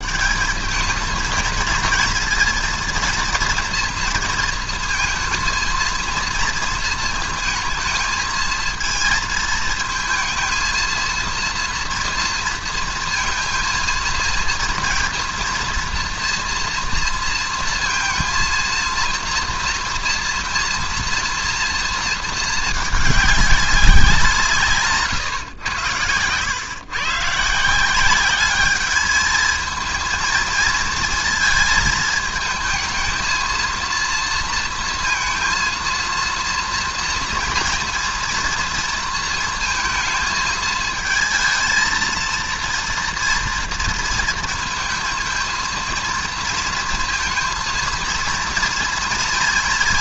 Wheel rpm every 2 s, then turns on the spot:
200, 230, 220, 230, 220, 220, 230, 230, 240, 230, 230, 220, 150, 120, 200, 230, 220, 230, 230, 230, 220, 230, 220, 230, 230.
none